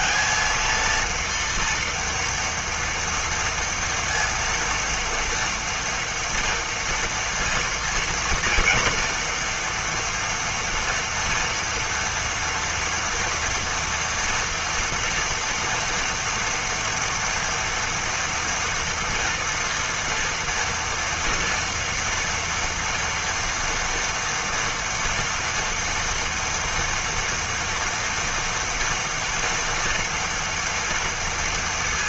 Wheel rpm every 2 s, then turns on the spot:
230, 230, 230, 230, 240, 230, 230, 240, 240, 230, 230, 230, 230, 230, 230, 230.
none